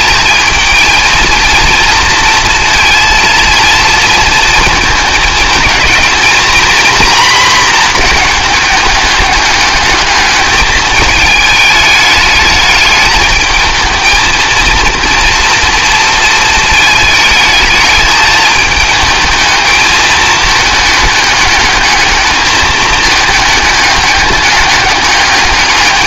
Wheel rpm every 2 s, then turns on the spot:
220, 230, 220, 230, 210, 220, 210, 230, 220, 220, 220, 210, 210.
none